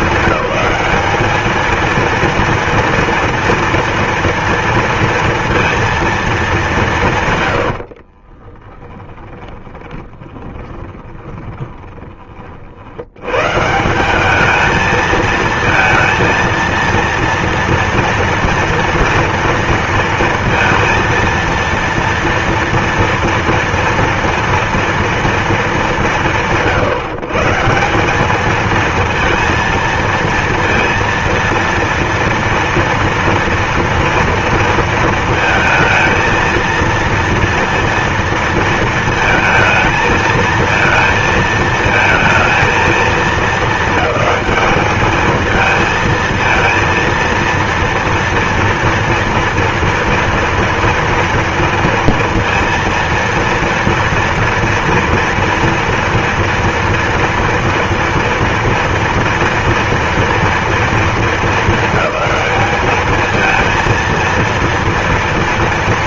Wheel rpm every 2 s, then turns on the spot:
200, 230, 230, 170, 20, 20, 80, 220, 230, 230, 230, 230, 230, 130, 220, 230, 230, 230, 230, 230, 220, 220, 210, 230, 230, 230, 230, 230, 240, 230, 220, 210, 230.
8-12